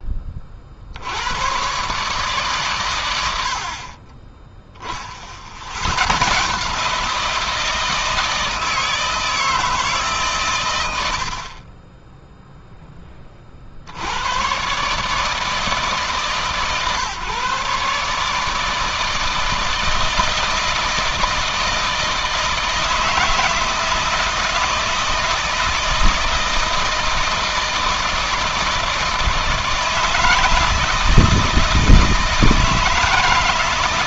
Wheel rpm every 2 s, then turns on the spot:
70, 120, 30, 160, 160, 80, 10, 140, 130, 160, 160, 160, 160, 160, 160, 160, 160.
none